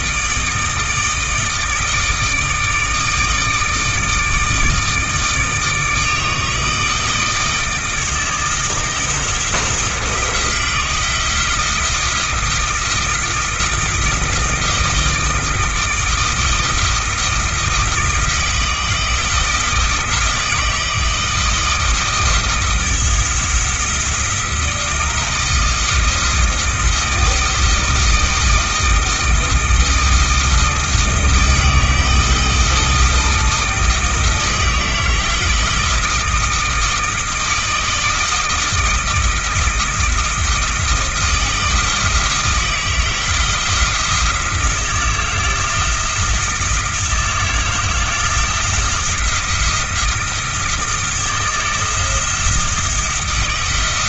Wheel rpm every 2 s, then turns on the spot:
160, 160, 160, 160, 160, 160, 170, 160, 160, 160, 160, 170, 160, 160, 160, 160, 160, 160, 160, 160, 160, 170, 170, 170, 170, 160, 160.
none